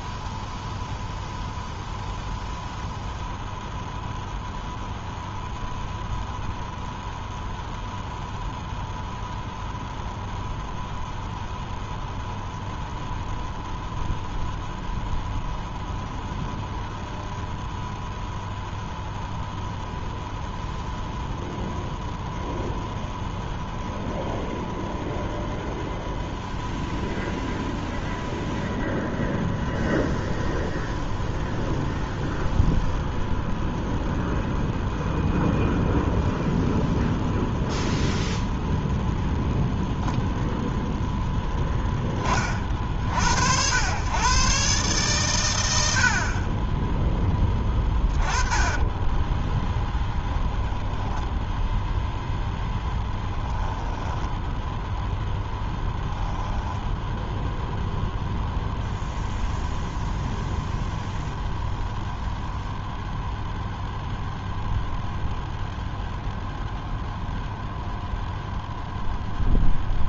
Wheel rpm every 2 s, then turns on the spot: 0, 0, 0, 0, 0, 0, 0, 0, 0, 0, 0, 0, 0, 0, 0, 0, 0, 0, 0, 0, 0, 50, 140, 20, 10, 0, 10, 0, 10, 0, 0, 0, 0, 0, 0.
48-50 52-54